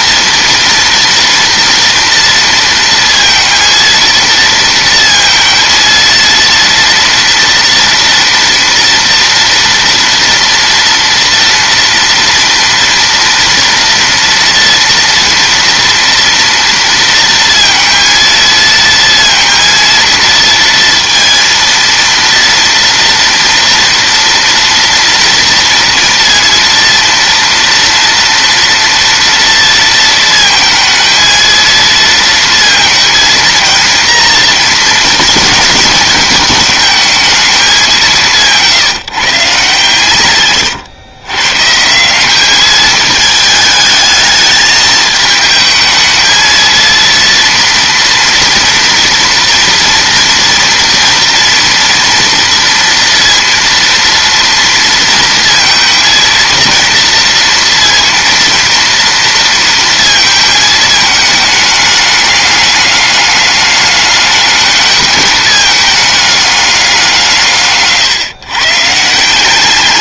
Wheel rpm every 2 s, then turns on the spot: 230, 230, 230, 230, 230, 230, 230, 230, 230, 230, 230, 230, 230, 230, 230, 220, 230, 230, 220, 160, 120, 210, 220, 230, 230, 240, 230, 230, 230, 230, 220, 210, 210, 200, 140.
40-42